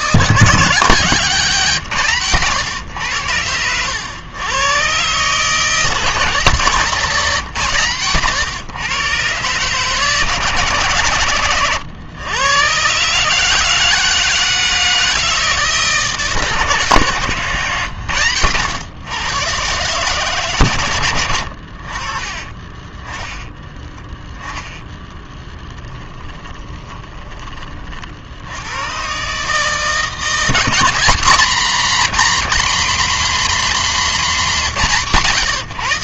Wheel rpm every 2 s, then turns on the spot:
160, 120, 110, 160, 130, 140, 120, 160, 140, 100, 140, 30, 10, 10, 80, 190, 250, 210.
22-24 26-28